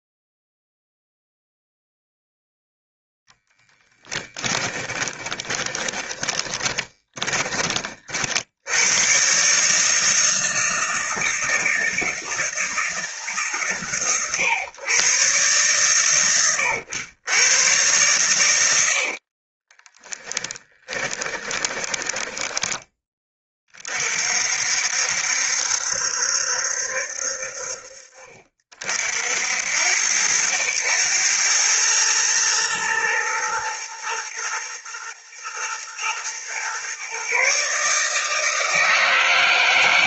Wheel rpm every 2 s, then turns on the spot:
0, 10, 20, 20, 100, 160, 150, 120, 120, 80, 20, 30, 70, 60, 60, 100, 110, 120, 130, 160.
4-8 18-22